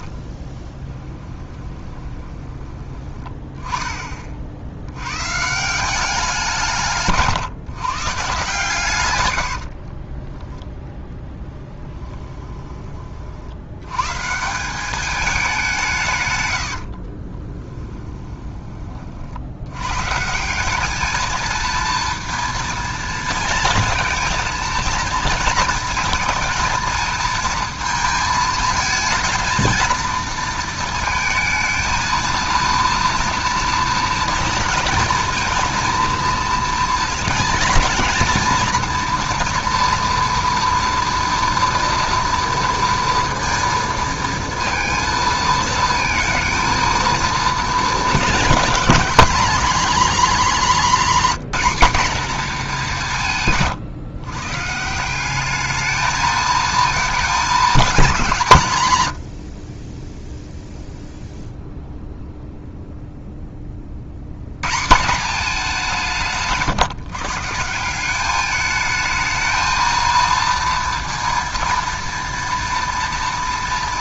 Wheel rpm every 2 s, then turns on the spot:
30, 20, 60, 160, 130, 10, 20, 180, 80, 20, 190, 230, 230, 230, 220, 230, 230, 230, 230, 230, 230, 230, 230, 220, 220, 240, 220, 140, 220, 160, 0, 0, 130, 160, 210, 230, 230.
0-2 16-18